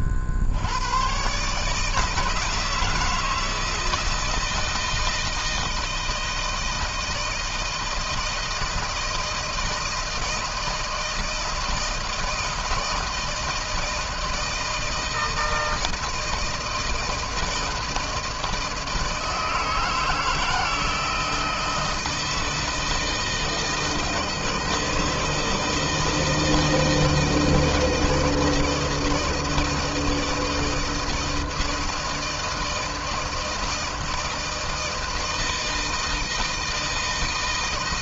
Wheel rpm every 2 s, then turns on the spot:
60, 160, 160, 160, 160, 160, 160, 160, 160, 160, 160, 160, 160, 160, 160, 160, 160, 160, 160.
none